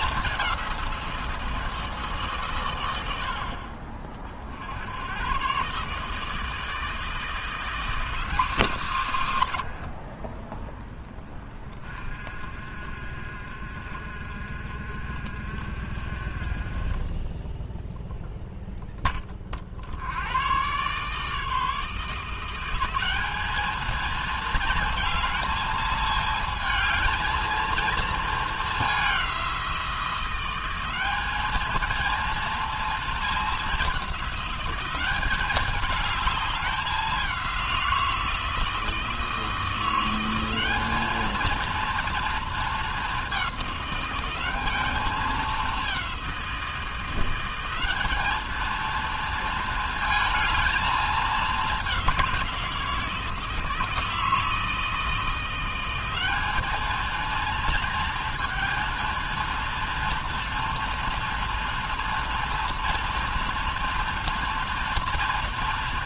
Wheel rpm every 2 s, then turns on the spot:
180, 100, 90, 160, 220, 20, 50, 50, 20, 0, 130, 190, 220, 220, 200, 190, 230, 190, 200, 160, 210, 210, 210, 170, 230, 220, 160, 160, 220, 230, 230, 230, 230.
none